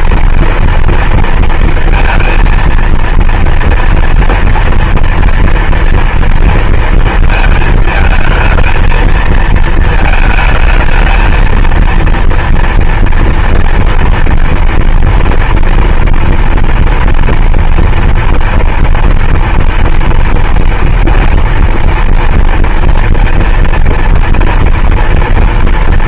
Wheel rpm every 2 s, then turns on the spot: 230, 230, 240, 230, 220, 220, 230, 230, 230, 230, 230, 230, 230.
none